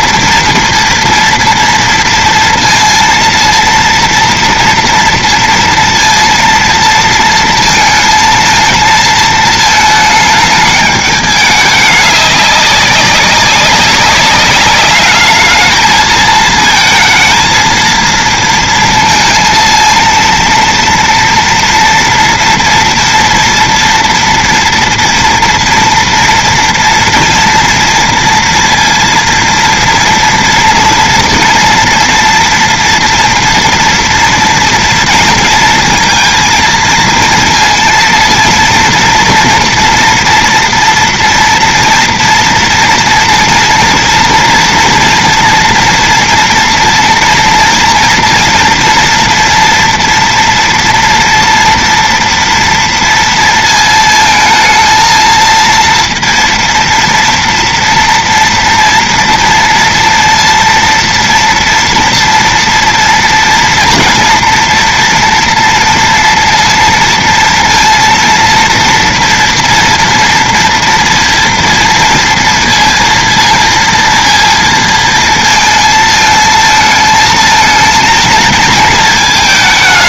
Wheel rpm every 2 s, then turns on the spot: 230, 230, 230, 230, 220, 220, 200, 200, 220, 230, 230, 230, 230, 230, 230, 230, 230, 230, 230, 230, 230, 230, 230, 240, 230, 230, 230, 220, 230, 230, 230, 230, 230, 230, 230, 230, 230, 230, 220, 230.
none